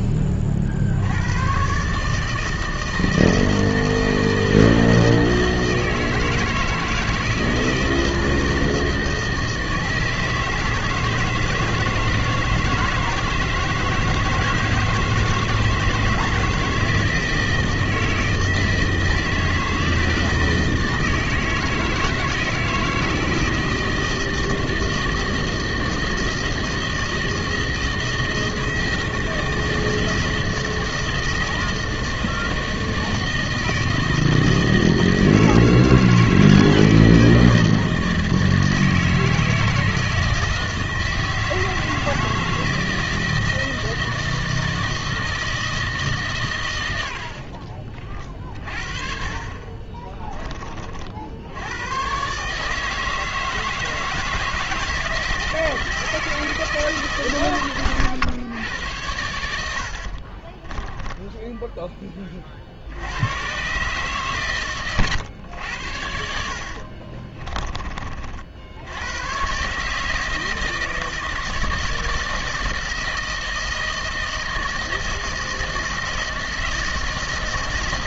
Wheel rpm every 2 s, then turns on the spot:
70, 160, 160, 160, 160, 160, 160, 160, 160, 160, 160, 170, 160, 160, 160, 160, 160, 160, 160, 160, 160, 160, 160, 90, 40, 50, 150, 160, 150, 100, 10, 80, 110, 40, 80, 160, 160, 160, 160.
66-68